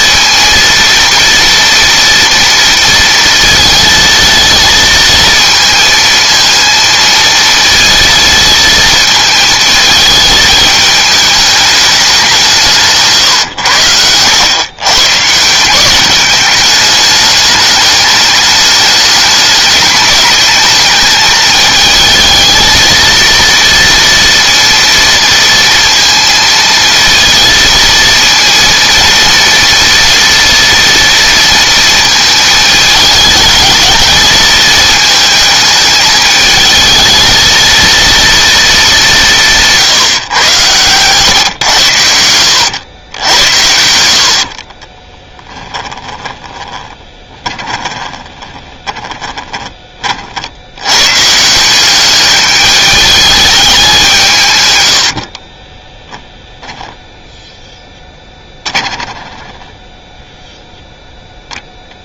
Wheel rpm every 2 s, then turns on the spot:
230, 230, 230, 230, 220, 210, 150, 130, 210, 210, 220, 230, 230, 230, 230, 230, 210, 220, 220, 210, 120, 80, 30, 20, 20, 90, 210, 100, 0, 10, 0.
42-50 54-56